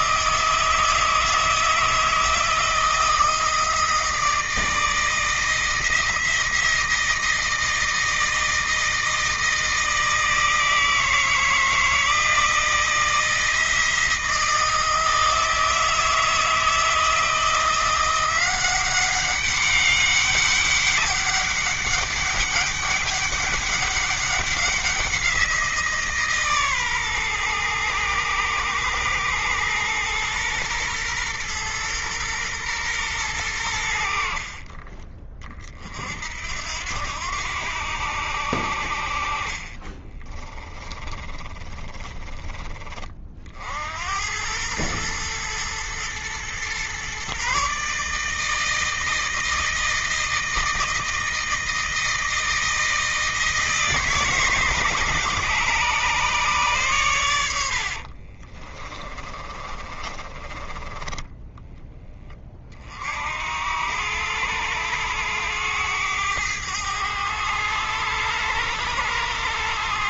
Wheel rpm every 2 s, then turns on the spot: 160, 160, 160, 170, 160, 160, 170, 160, 160, 180, 200, 200, 190, 140, 110, 120, 120, 40, 70, 70, 20, 30, 100, 120, 160, 160, 160, 150, 130, 30, 20, 30, 100, 100, 100.
34-36 40-42 58-62